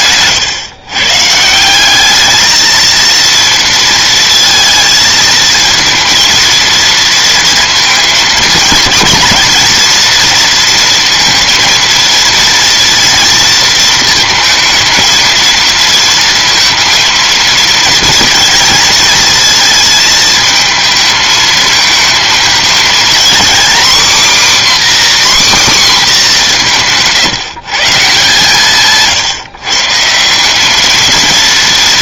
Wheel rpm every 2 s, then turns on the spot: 130, 230, 230, 230, 220, 230, 230, 220, 230, 230, 220, 230, 280, 150, 150, 220.
none